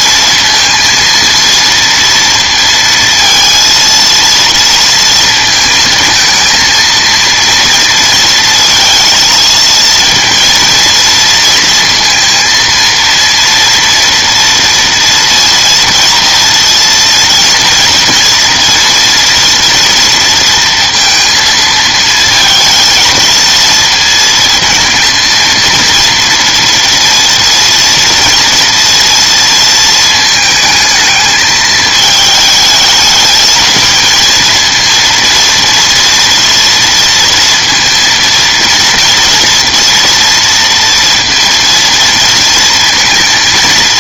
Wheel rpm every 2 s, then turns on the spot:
230, 230, 230, 220, 230, 230, 230, 230, 230, 230, 230, 220, 220, 230, 230, 220, 220, 230, 230, 230, 230, 230.
none